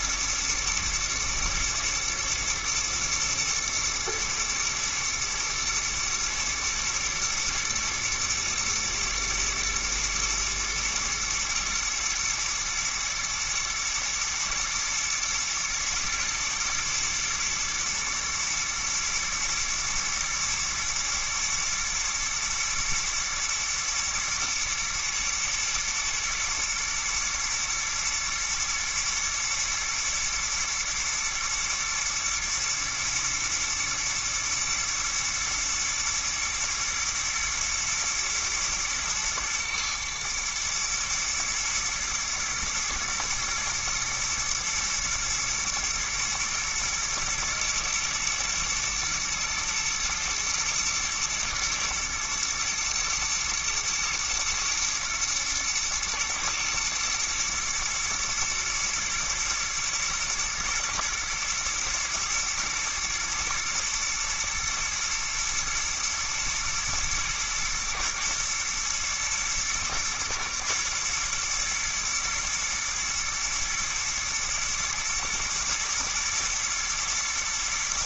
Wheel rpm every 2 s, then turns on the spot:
120, 120, 110, 120, 120, 110, 120, 120, 120, 120, 110, 110, 120, 110, 120, 110, 110, 120, 110, 110, 110, 120, 120, 110, 110, 120, 120, 120, 110, 110, 110, 110, 110, 110, 110, 120, 120, 110, 110.
none